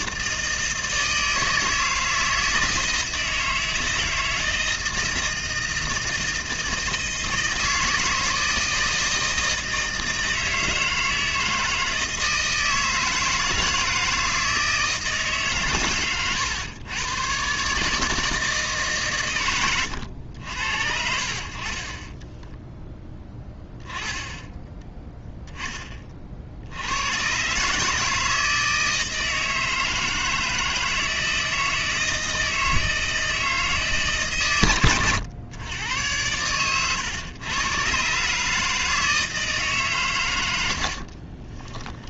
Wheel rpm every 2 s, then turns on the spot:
160, 160, 160, 160, 160, 160, 160, 160, 110, 150, 70, 10, 10, 70, 160, 160, 160, 120, 110, 150, 80.
40-42